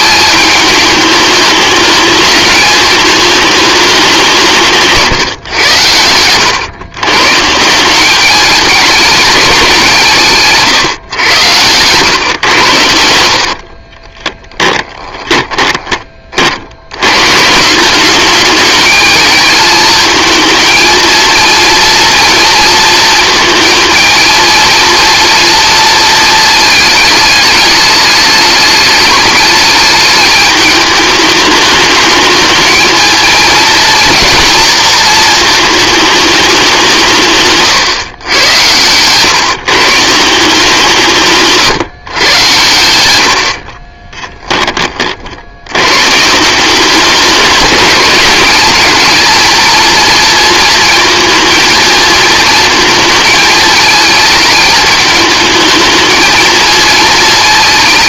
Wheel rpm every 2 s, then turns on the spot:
210, 220, 160, 110, 210, 140, 100, 20, 80, 210, 230, 230, 230, 220, 210, 210, 220, 230, 190, 110, 170, 100, 30, 190, 220, 230, 220, 210, 220.
10-12 14-16 38-40